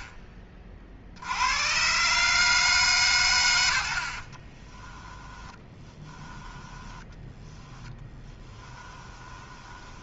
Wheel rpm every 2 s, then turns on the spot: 50, 140, 20, 10, 10.
4-10